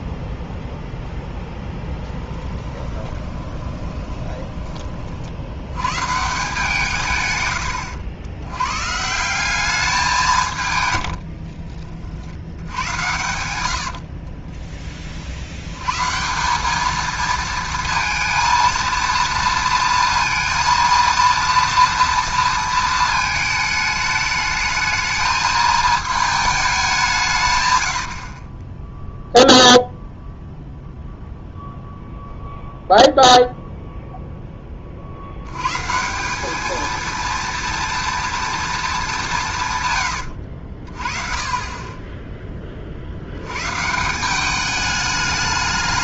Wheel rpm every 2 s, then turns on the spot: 0, 10, 30, 160, 120, 130, 90, 20, 200, 230, 230, 230, 220, 210, 10, 0, 0, 20, 220, 220, 60, 40, 210.
2-4 10-12 28-30